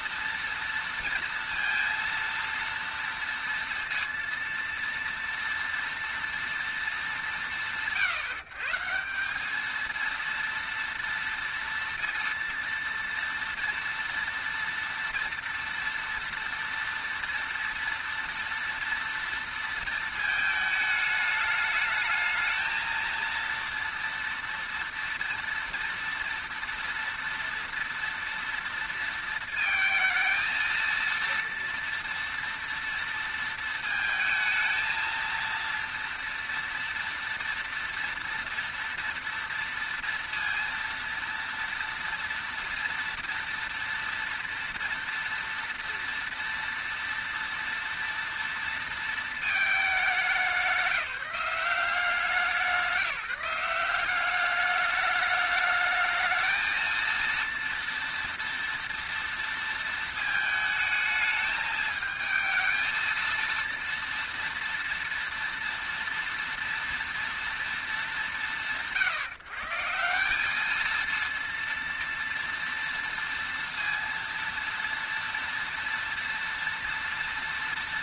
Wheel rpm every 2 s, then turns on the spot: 230, 230, 230, 230, 150, 230, 230, 230, 230, 230, 220, 220, 230, 230, 230, 230, 230, 220, 230, 230, 230, 230, 230, 230, 230, 190, 180, 200, 220, 230, 220, 220, 230, 230, 150, 210, 230, 230, 230.
none